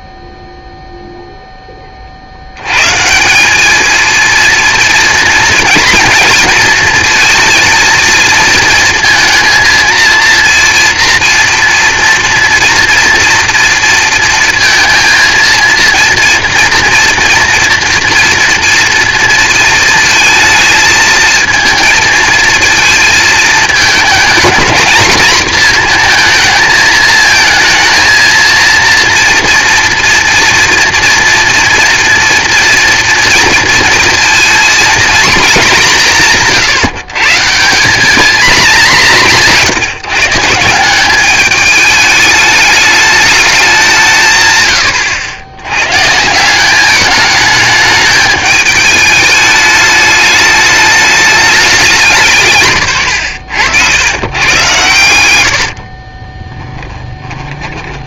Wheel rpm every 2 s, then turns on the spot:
0, 90, 230, 230, 230, 230, 240, 230, 230, 240, 220, 230, 220, 230, 230, 230, 230, 230, 160, 220, 150, 210, 130, 190, 210, 210, 140, 110, 20.
56-58